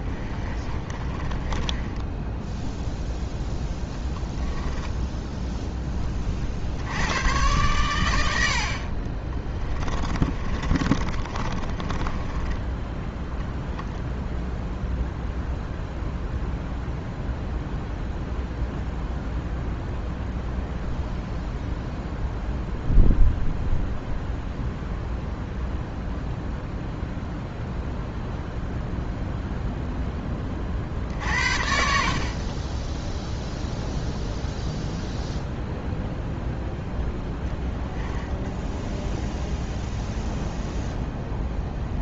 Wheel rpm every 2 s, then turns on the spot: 30, 0, 10, 80, 50, 30, 10, 0, 0, 0, 0, 0, 0, 0, 0, 40, 10, 0, 0, 0, 0.
0-2 4-6 8-14